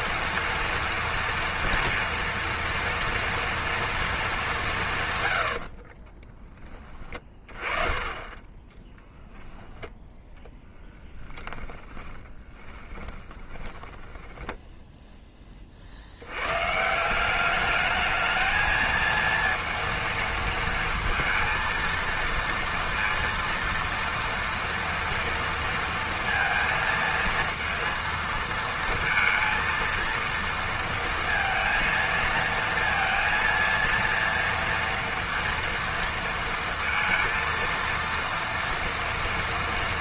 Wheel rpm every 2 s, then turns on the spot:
230, 230, 190, 20, 10, 10, 20, 10, 120, 220, 230, 230, 230, 230, 230, 230, 230, 230, 230, 230.
8-16